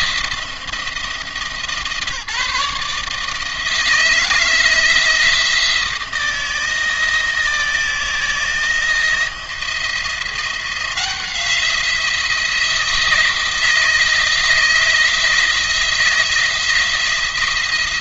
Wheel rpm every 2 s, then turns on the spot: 170, 160, 170, 170, 170, 170, 170, 160, 160.
none